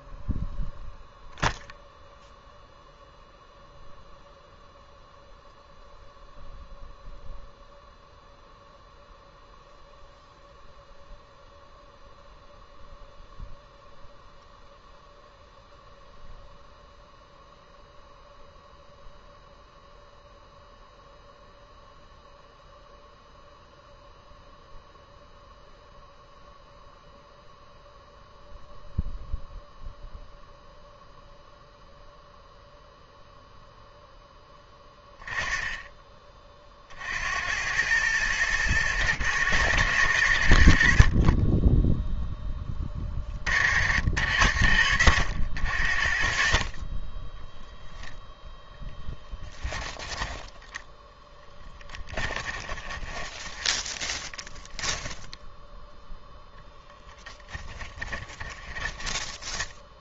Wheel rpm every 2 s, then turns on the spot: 0, 0, 0, 0, 0, 0, 0, 0, 0, 0, 0, 0, 0, 0, 0, 0, 0, 20, 40, 110, 60, 20, 90, 40, 0, 10, 20, 10, 10, 10.
52-56 58-60